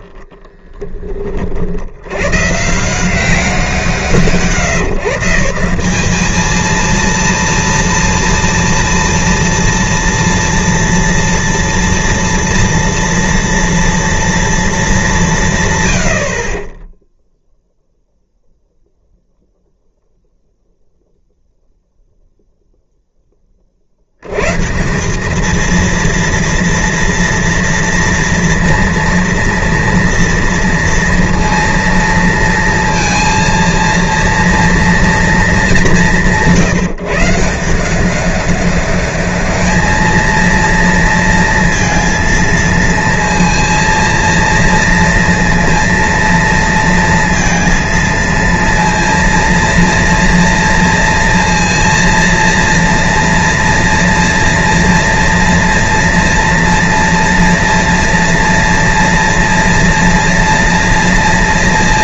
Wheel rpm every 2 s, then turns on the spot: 10, 140, 150, 220, 230, 230, 230, 230, 40, 0, 0, 0, 130, 230, 240, 230, 230, 230, 170, 200, 230, 230, 230, 230, 230, 230, 230, 230, 230, 230, 240.
none